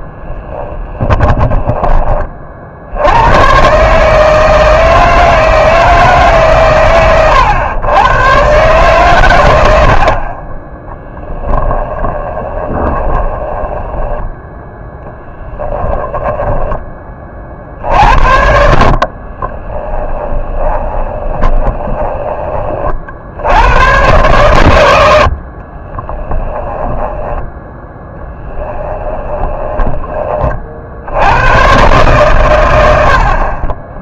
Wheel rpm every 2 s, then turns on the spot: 10, 60, 160, 130, 130, 10, 20, 0, 20, 60, 20, 20, 110, 10, 10, 60, 100.
0-2 12-14 18-22 26-30